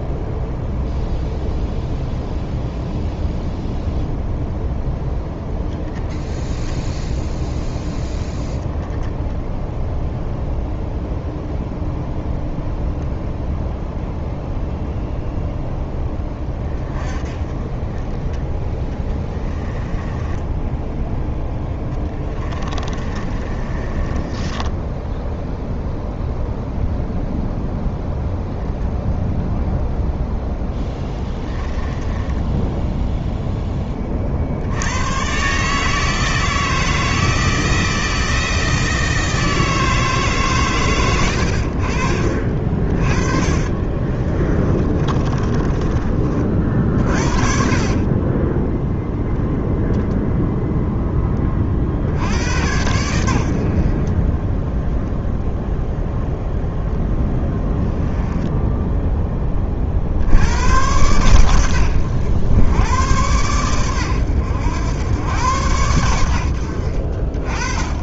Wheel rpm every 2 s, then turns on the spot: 0, 0, 0, 0, 10, 0, 0, 0, 20, 20, 10, 20, 10, 0, 0, 10, 10, 80, 160, 160, 130, 50, 30, 50, 10, 0, 90, 0, 0, 10, 100, 100, 90, 70.
18-26 30-34 42-50